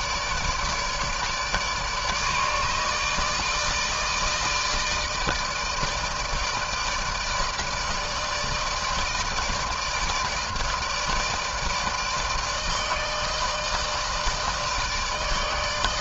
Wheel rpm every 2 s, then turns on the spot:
150, 150, 160, 160, 160, 150, 160, 160.
none